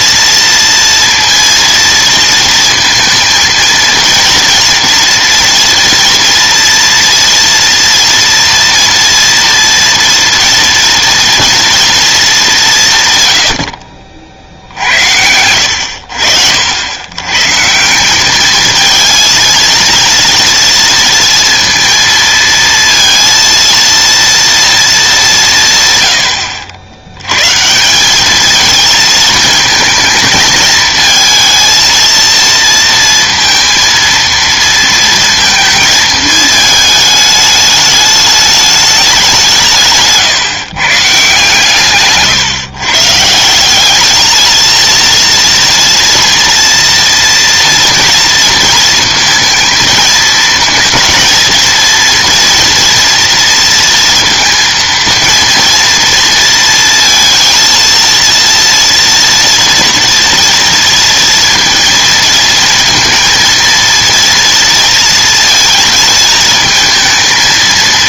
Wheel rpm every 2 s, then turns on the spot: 230, 230, 240, 230, 240, 230, 170, 70, 70, 210, 230, 230, 230, 100, 220, 220, 230, 230, 220, 210, 150, 150, 220, 230, 230, 220, 230, 230, 230, 230, 230, 230, 230, 220.
none